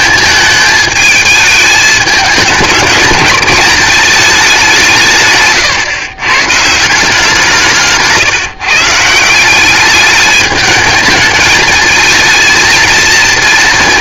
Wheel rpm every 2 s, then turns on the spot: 220, 210, 190, 140, 140, 210, 230.
none